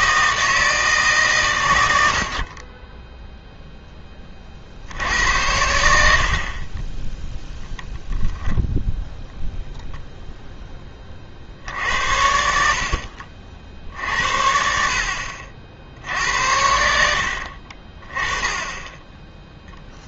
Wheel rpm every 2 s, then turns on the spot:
160, 30, 50, 30, 10, 10, 70, 70, 80, 10.
none